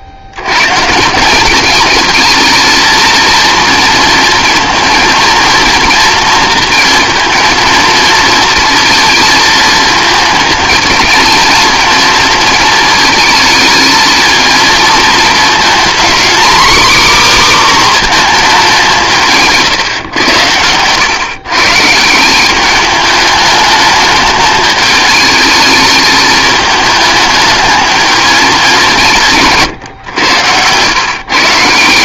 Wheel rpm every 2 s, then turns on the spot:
110, 220, 220, 230, 230, 210, 230, 230, 270, 210, 100, 200, 210, 220, 200, 110.
none